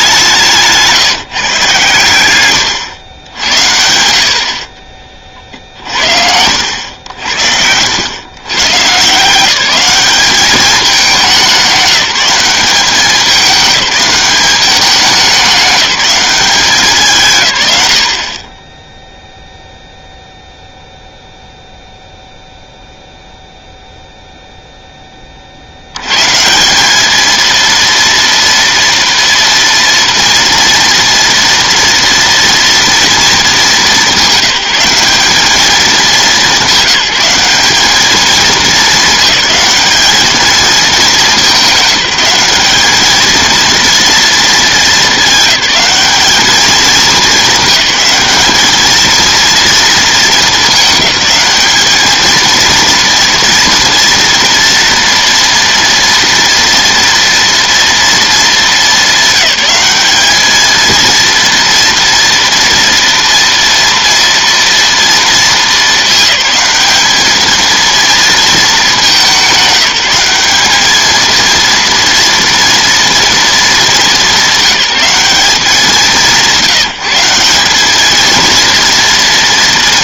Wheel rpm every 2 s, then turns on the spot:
160, 110, 40, 80, 130, 210, 200, 200, 180, 10, 0, 0, 10, 200, 230, 240, 230, 180, 200, 210, 220, 210, 220, 220, 220, 210, 230, 230, 230, 220, 220, 230, 230, 210, 210, 210, 230, 200, 180, 230.
4-6